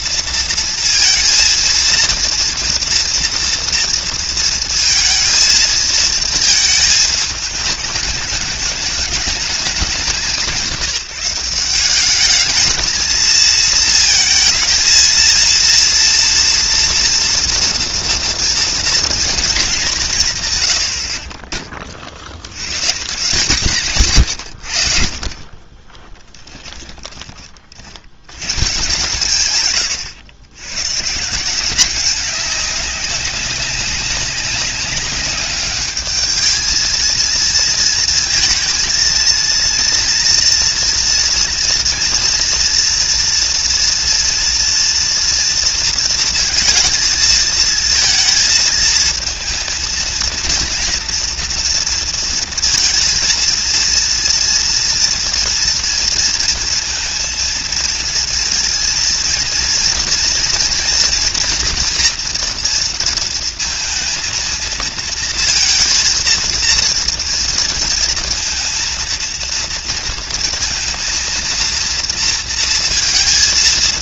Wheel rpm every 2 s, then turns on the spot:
230, 230, 230, 230, 210, 190, 210, 230, 230, 230, 100, 100, 80, 10, 130, 110, 200, 200, 220, 230, 230, 230, 240, 230, 220, 230, 230, 230, 230, 230, 230, 230, 230, 230, 230, 230, 230.
26-28